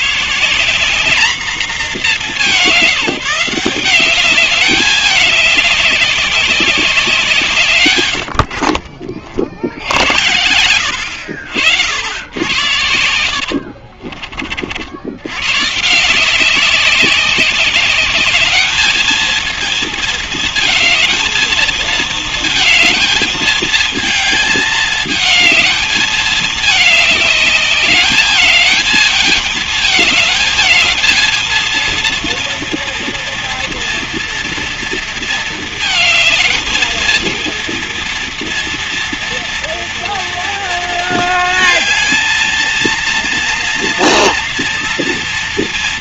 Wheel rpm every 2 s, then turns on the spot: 200, 180, 190, 160, 50, 80, 80, 110, 190, 220, 220, 220, 220, 210, 220, 220, 230, 230, 220, 230, 230, 230, 230.
12-14